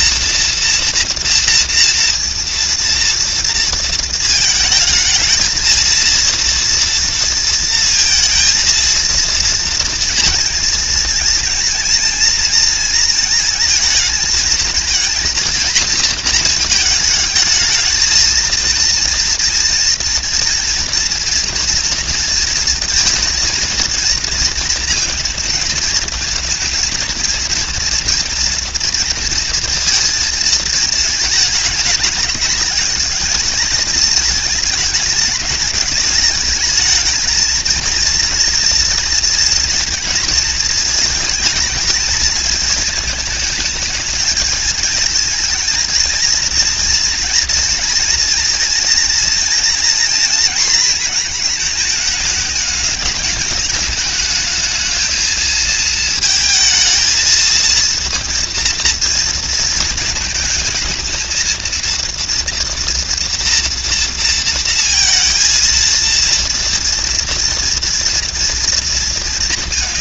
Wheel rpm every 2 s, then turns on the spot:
230, 230, 220, 230, 230, 230, 230, 220, 220, 230, 230, 230, 230, 230, 230, 220, 210, 220, 220, 230, 220, 220, 220, 230, 230, 230, 210, 220, 220, 230, 230, 230, 230, 230, 230.
none